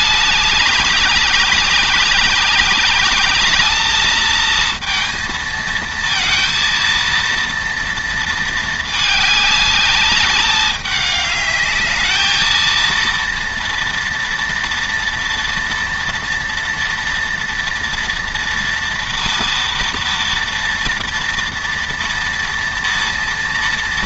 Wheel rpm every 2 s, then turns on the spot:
190, 210, 230, 230, 210, 210, 230, 230, 230, 230, 230, 230.
none